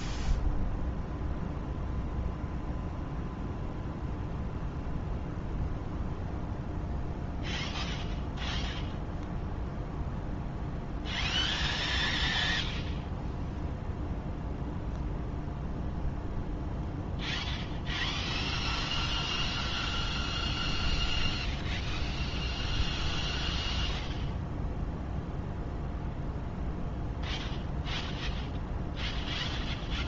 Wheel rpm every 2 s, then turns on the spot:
0, 0, 0, 0, 0, 0, 0, 0, 0, 0, 0, 0, 0, 0, 0.
none